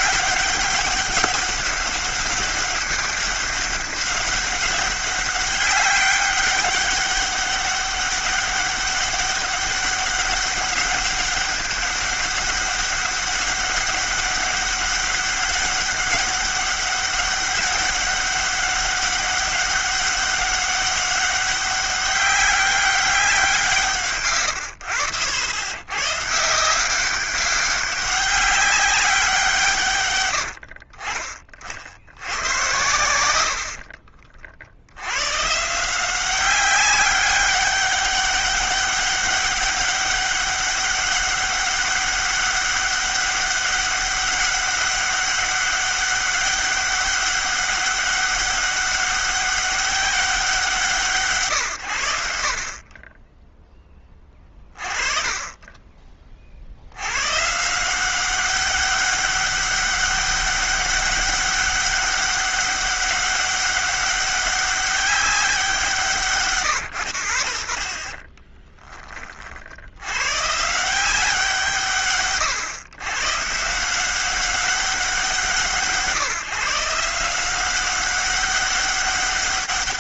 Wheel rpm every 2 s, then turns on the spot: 200, 200, 190, 200, 200, 200, 200, 200, 200, 200, 190, 200, 130, 140, 200, 110, 80, 50, 180, 200, 200, 200, 200, 200, 200, 170, 60, 20, 50, 190, 200, 200, 200, 140, 20, 120, 130, 180, 160, 190.
24-26 68-70